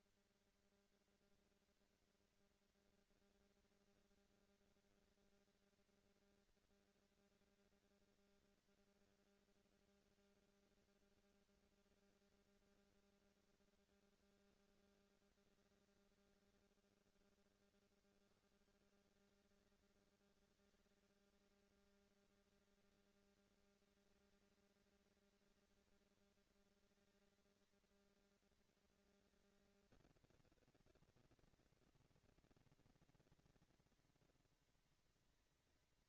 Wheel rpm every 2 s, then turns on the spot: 240, 240, 230, 230, 230, 220, 230, 200, 110, 160, 210, 230, 230, 230, 230, 240, 230, 230.
none